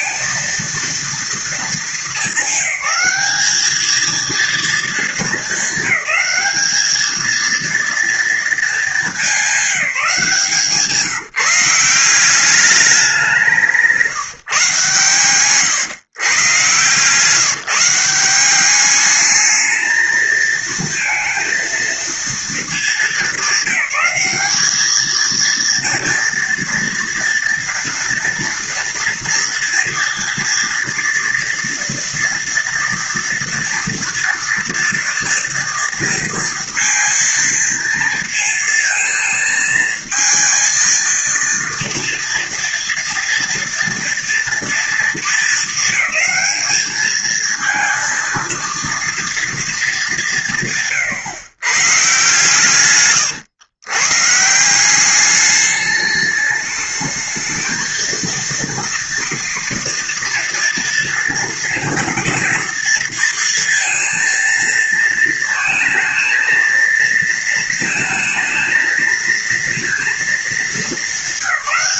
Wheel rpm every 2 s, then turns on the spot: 230, 200, 220, 220, 210, 170, 190, 140, 140, 210, 220, 210, 210, 230, 230, 230, 230, 230, 230, 230, 230, 230, 230, 220, 230, 140, 120, 190, 220, 230, 230, 230, 230, 230, 220, 200.
52-54